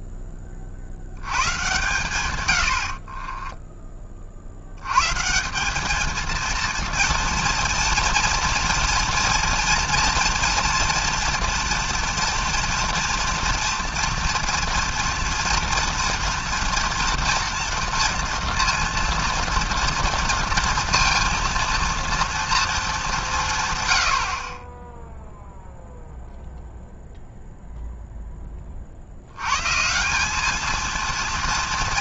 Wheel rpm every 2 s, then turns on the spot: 70, 70, 100, 230, 230, 230, 230, 230, 230, 230, 230, 210, 20, 0, 50, 230.
none